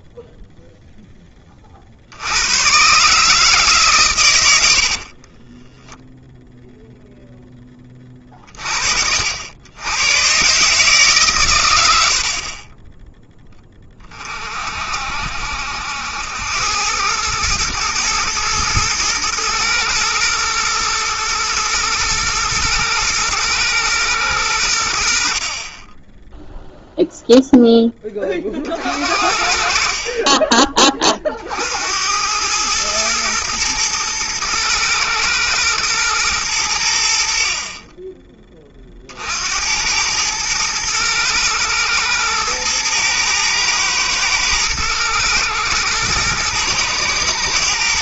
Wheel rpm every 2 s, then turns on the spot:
0, 80, 100, 0, 50, 140, 30, 50, 90, 110, 120, 110, 90, 0, 50, 30, 110, 110, 90, 40, 110, 110, 110, 120.
none